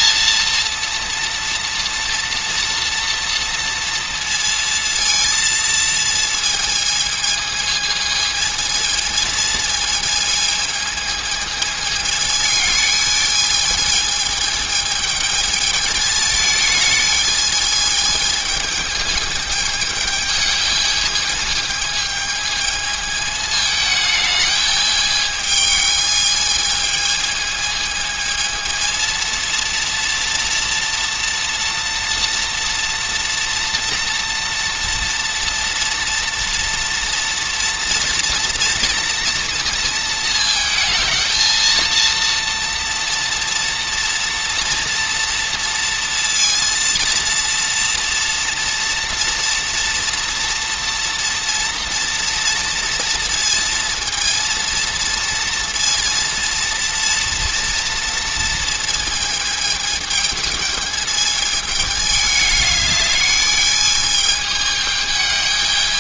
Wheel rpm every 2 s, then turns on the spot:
230, 230, 230, 220, 220, 220, 220, 220, 210, 220, 220, 220, 210, 220, 230, 230, 230, 240, 230, 230, 220, 230, 230, 230, 230, 230, 230, 230, 230, 220, 220, 210, 220.
none